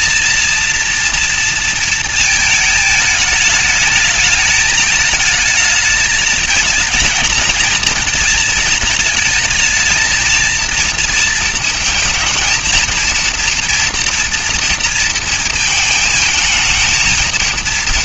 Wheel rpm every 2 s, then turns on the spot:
230, 210, 220, 230, 220, 230, 230, 230, 220.
none